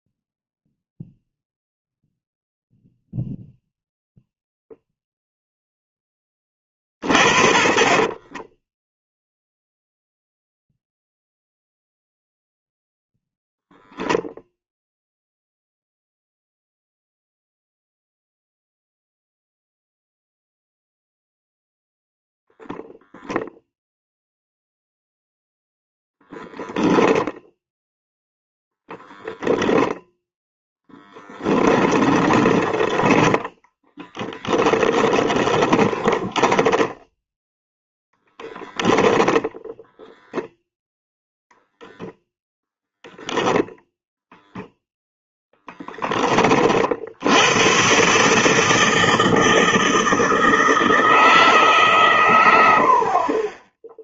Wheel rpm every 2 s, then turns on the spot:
0, 0, 0, 30, 10, 0, 0, 0, 0, 0, 0, 0, 0, 10, 0, 10, 10, 20, 10, 0, 0, 0, 0, 50, 160, 160, 70.
8-10 30-32 36-38